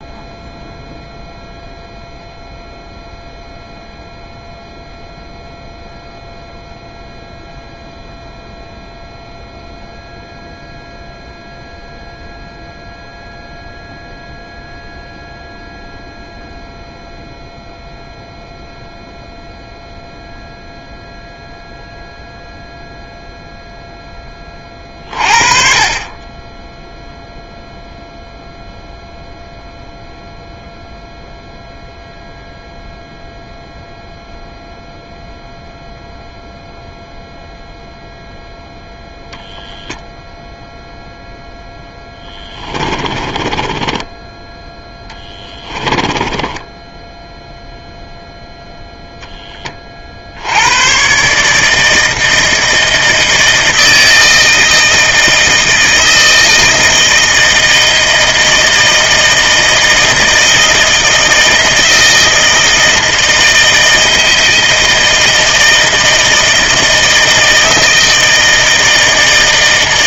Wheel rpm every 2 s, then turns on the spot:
0, 0, 0, 0, 0, 0, 0, 0, 0, 0, 0, 0, 30, 10, 0, 0, 0, 0, 0, 0, 0, 10, 10, 10, 0, 80, 160, 160, 160, 160, 160, 160, 160, 160, 160.
42-48